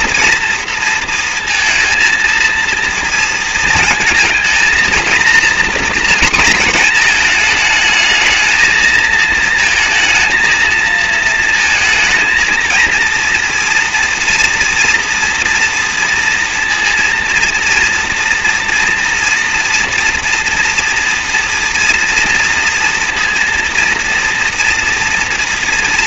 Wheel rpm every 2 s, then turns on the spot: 230, 230, 230, 240, 220, 230, 230, 230, 230, 230, 230, 230, 230.
none